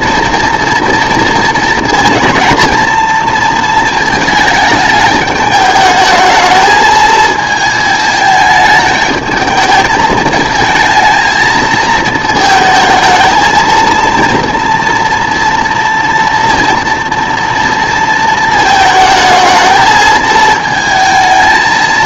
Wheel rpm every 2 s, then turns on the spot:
230, 230, 220, 220, 210, 220, 220, 230, 240, 220, 220.
none